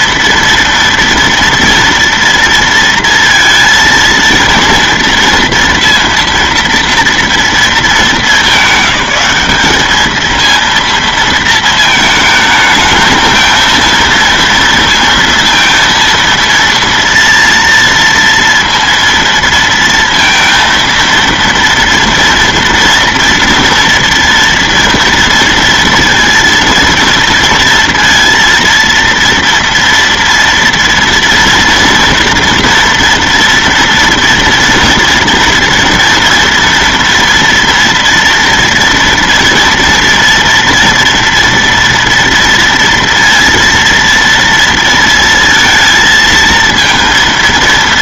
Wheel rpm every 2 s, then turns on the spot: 230, 230, 230, 230, 200, 230, 220, 230, 230, 230, 230, 230, 230, 230, 230, 230, 230, 230, 230, 230, 230, 230, 230, 230.
none